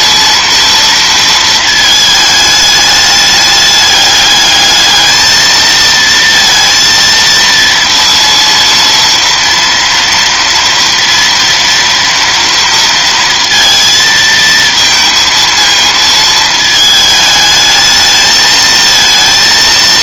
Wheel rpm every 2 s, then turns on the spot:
230, 210, 220, 230, 230, 230, 230, 230, 220, 230.
none